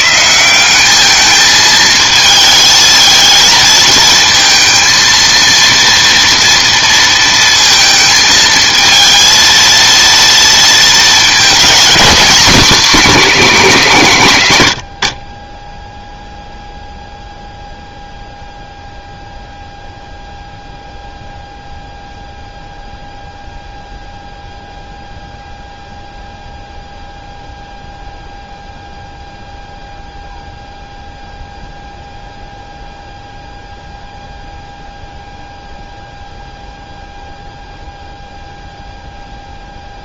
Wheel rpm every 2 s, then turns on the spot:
190, 220, 230, 230, 220, 230, 240, 110, 0, 0, 0, 0, 0, 0, 0, 0, 0, 0, 0, 0.
none